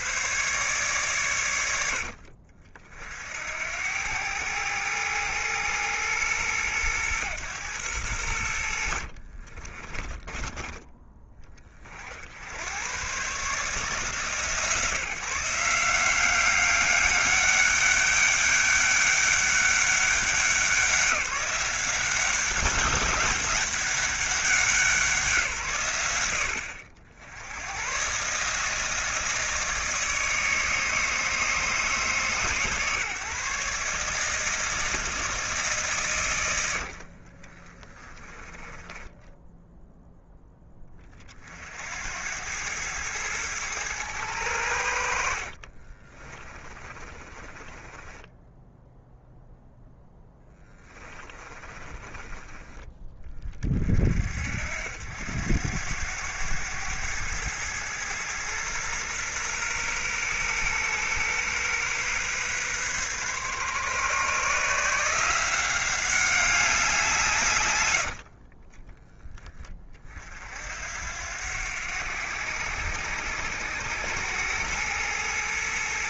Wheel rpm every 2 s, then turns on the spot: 120, 50, 110, 110, 60, 10, 120, 160, 200, 200, 190, 200, 170, 60, 160, 150, 150, 160, 70, 10, 40, 110, 80, 20, 0, 20, 20, 80, 100, 120, 120, 130, 160, 180, 20, 70, 100, 110.
8-10 36-38 46-48 50-52